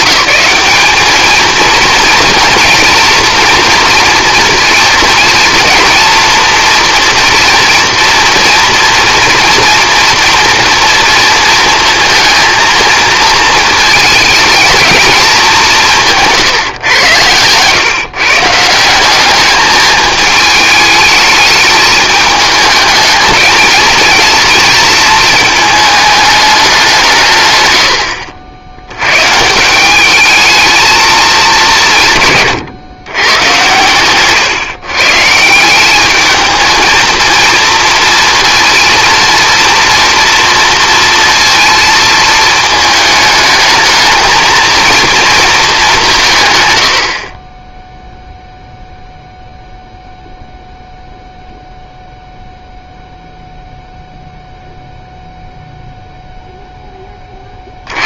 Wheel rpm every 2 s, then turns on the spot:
210, 240, 230, 230, 230, 230, 220, 220, 120, 170, 210, 210, 230, 190, 90, 220, 140, 130, 220, 230, 230, 220, 230, 90, 0, 0, 0, 0, 10.
none